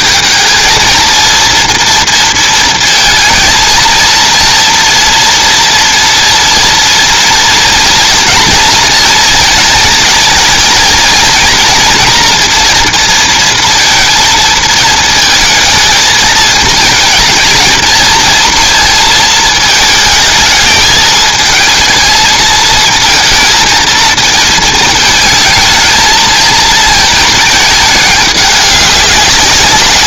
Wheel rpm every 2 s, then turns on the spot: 220, 230, 230, 240, 230, 220, 230, 220, 220, 230, 220, 230, 220, 220, 200.
none